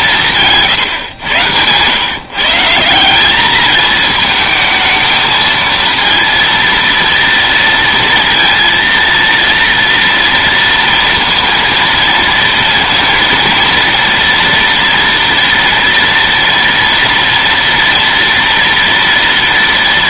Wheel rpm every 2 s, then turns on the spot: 150, 160, 220, 230, 230, 230, 230, 240, 230, 230.
0-2